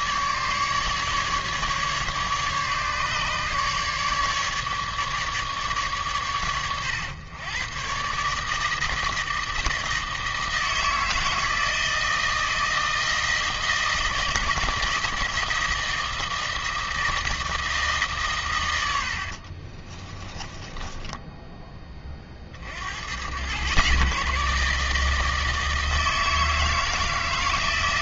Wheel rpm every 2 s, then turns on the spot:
150, 150, 150, 110, 160, 160, 160, 160, 160, 100, 20, 70, 160, 160.
20-22